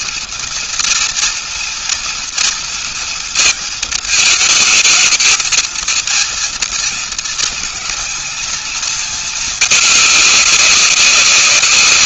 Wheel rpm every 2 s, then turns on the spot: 230, 230, 220, 220, 220, 190.
none